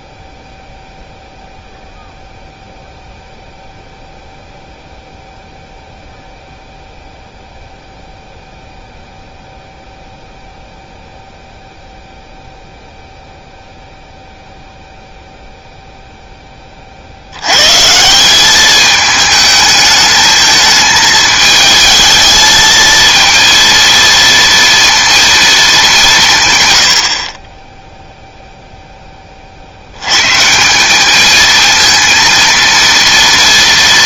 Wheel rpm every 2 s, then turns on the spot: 0, 0, 0, 0, 0, 0, 0, 0, 20, 210, 220, 220, 230, 100, 0, 180, 230.
none